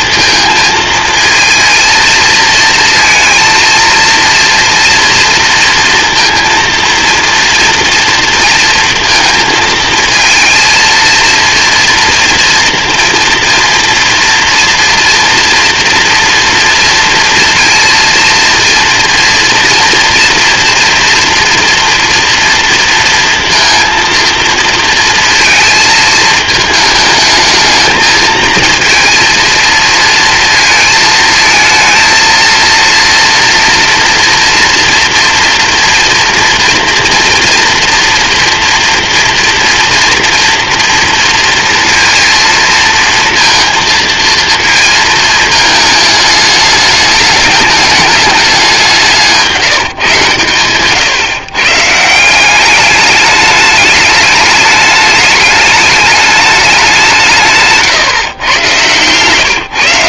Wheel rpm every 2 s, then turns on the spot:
220, 230, 230, 230, 230, 230, 230, 230, 230, 230, 230, 230, 230, 220, 220, 230, 230, 240, 230, 230, 240, 230, 230, 210, 200, 130, 190, 210, 200, 120.
none